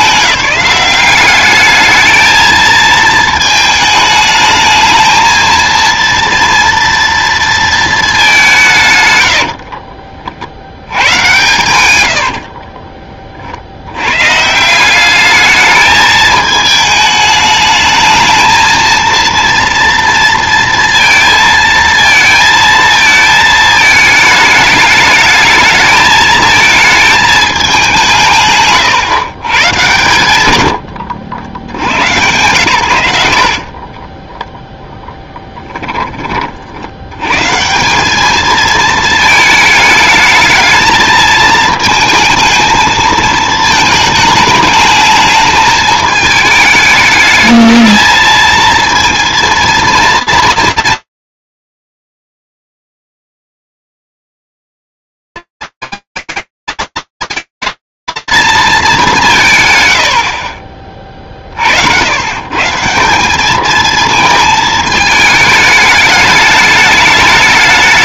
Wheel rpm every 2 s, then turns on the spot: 200, 220, 220, 230, 160, 80, 50, 160, 210, 220, 230, 220, 210, 220, 140, 110, 120, 10, 60, 220, 220, 220, 220, 210, 230, 230, 220, 150, 40, 200, 220, 210, 220, 220.
12-14 28-32